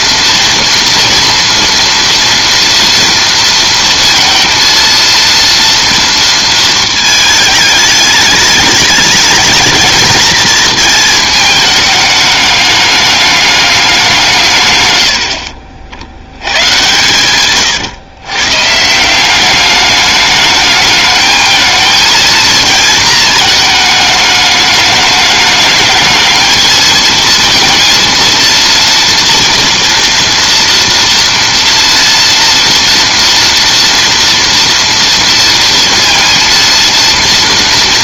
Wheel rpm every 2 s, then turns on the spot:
230, 230, 230, 220, 210, 220, 210, 110, 120, 150, 210, 230, 210, 220, 230, 240, 230, 230, 230.
none